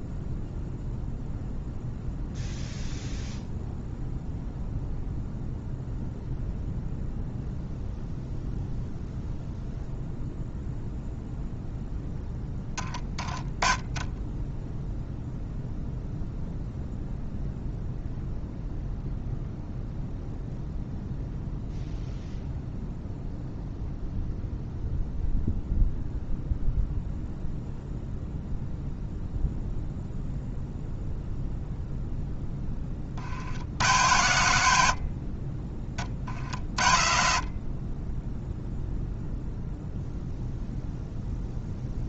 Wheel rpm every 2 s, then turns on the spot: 0, 0, 0, 0, 0, 0, 20, 0, 0, 0, 0, 0, 0, 0, 0, 0, 30, 60, 60, 0, 0.
12-14